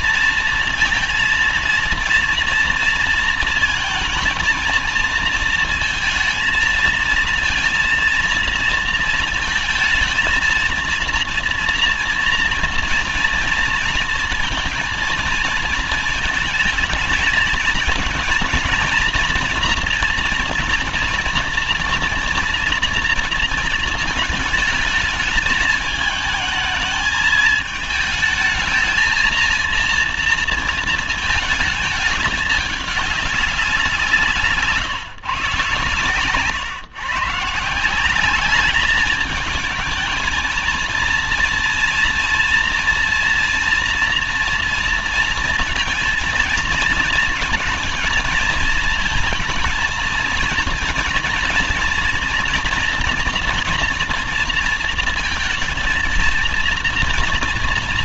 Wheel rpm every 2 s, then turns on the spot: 230, 230, 220, 220, 230, 230, 230, 230, 230, 220, 230, 230, 220, 220, 220, 230, 210, 160, 130, 200, 220, 230, 230, 230, 230, 230, 230, 230, 230.
none